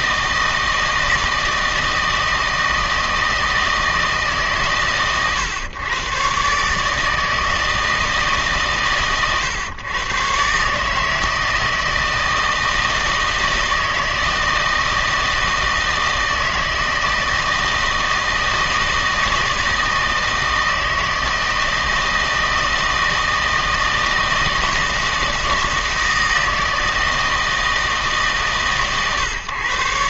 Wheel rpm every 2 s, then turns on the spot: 160, 160, 150, 140, 140, 140, 160, 160, 160, 160, 160, 160, 160, 160, 140.
none